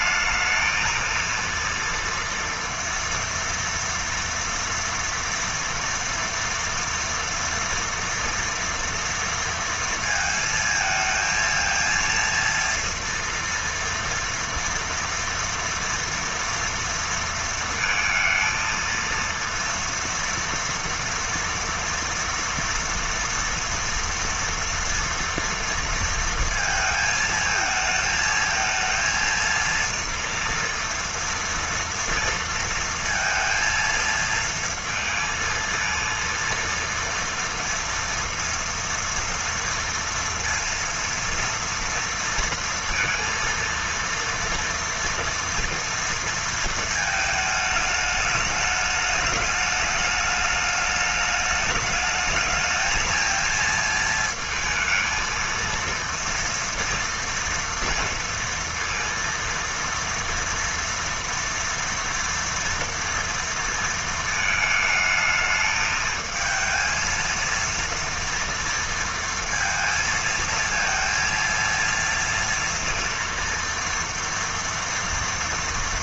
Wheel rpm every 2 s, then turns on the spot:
230, 230, 240, 240, 230, 230, 230, 230, 230, 230, 230, 230, 240, 220, 220, 230, 230, 230, 230, 230, 230, 230, 230, 230, 210, 210, 220, 220, 230, 230, 230, 230, 220, 220, 230, 230, 230, 230.
none